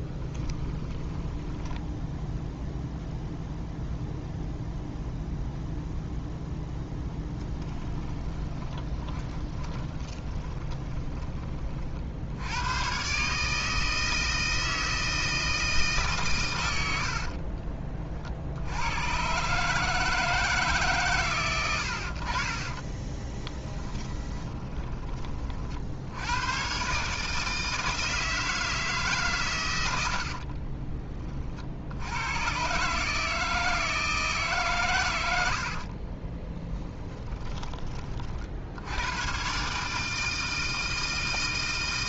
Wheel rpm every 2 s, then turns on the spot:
10, 0, 0, 0, 20, 20, 120, 160, 100, 80, 150, 30, 20, 120, 160, 40, 140, 130, 10, 70, 160.
0-2 8-12 22-26 30-32 36-38